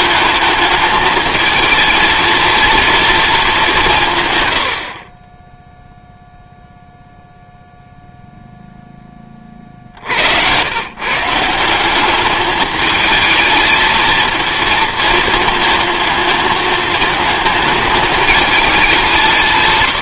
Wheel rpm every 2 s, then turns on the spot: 220, 230, 100, 0, 0, 120, 220, 230, 220, 200.
none